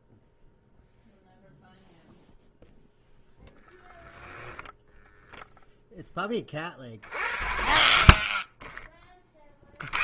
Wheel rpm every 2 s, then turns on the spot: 0, 0, 0, 50, 20.
none